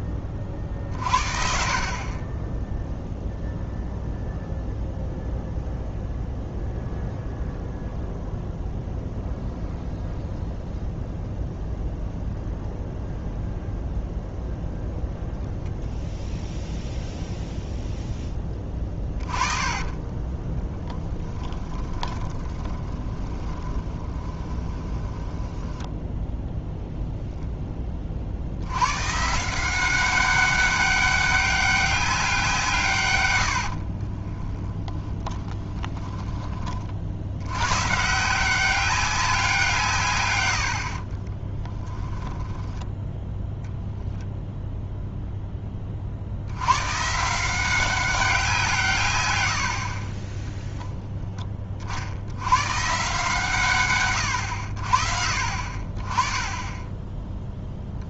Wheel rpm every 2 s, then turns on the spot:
20, 20, 0, 0, 0, 0, 0, 0, 0, 20, 20, 20, 20, 0, 70, 200, 160, 10, 30, 190, 80, 10, 0, 100, 170, 10, 130, 80, 10.
18-26 34-36 40-44